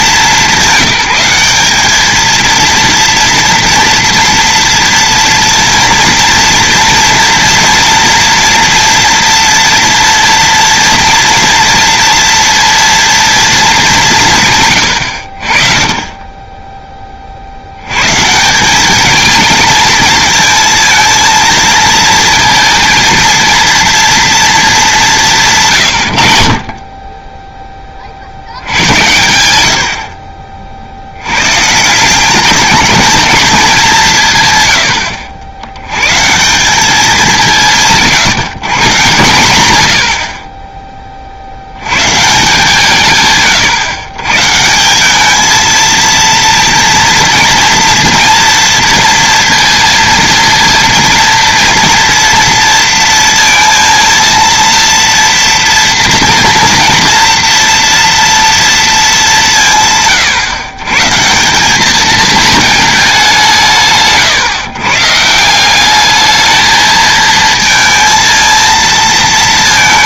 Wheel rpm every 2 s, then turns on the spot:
200, 230, 230, 230, 230, 230, 230, 130, 10, 190, 220, 230, 220, 50, 90, 50, 210, 110, 190, 150, 20, 160, 160, 230, 230, 230, 230, 230, 230, 230, 130, 220, 140, 220, 230.
none